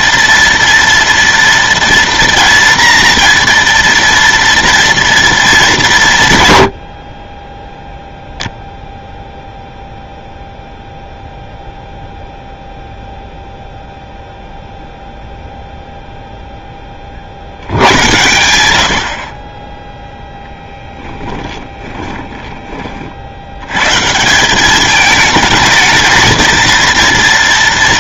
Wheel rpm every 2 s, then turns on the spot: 230, 230, 230, 80, 0, 0, 0, 0, 20, 90, 10, 40, 210, 230.
20-22